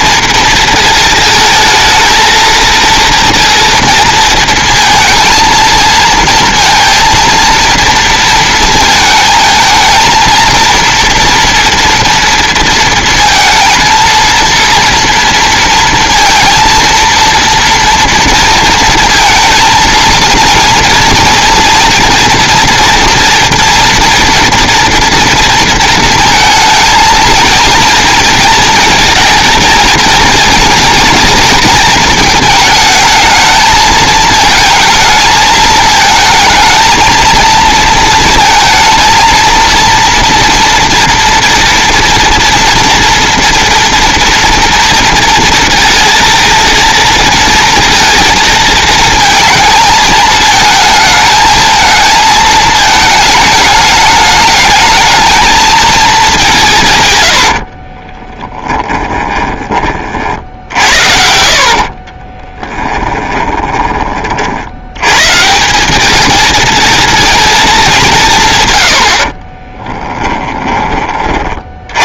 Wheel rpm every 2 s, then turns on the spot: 230, 230, 220, 230, 220, 230, 230, 230, 230, 230, 230, 230, 230, 230, 230, 240, 220, 220, 220, 230, 230, 240, 230, 230, 230, 220, 220, 220, 150, 20, 60, 10, 90, 230, 100, 20.
58-64